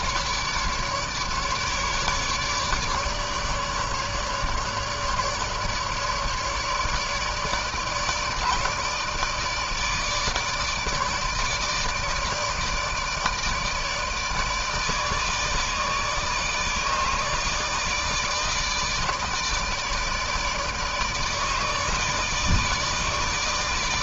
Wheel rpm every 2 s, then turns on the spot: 150, 150, 150, 150, 150, 150, 160, 150, 150, 160, 150, 150.
none